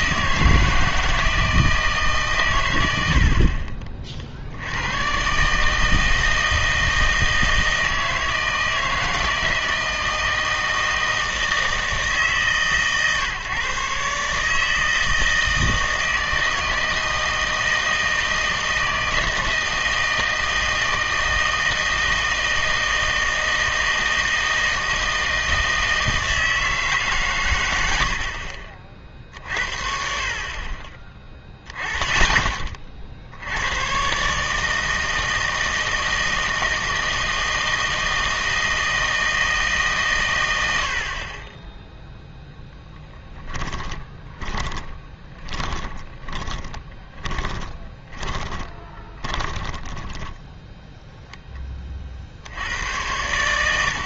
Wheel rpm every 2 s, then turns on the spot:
160, 110, 100, 160, 160, 160, 140, 160, 160, 160, 160, 160, 160, 160, 50, 30, 30, 160, 160, 160, 80, 10, 30, 30, 20, 0, 90.
44-50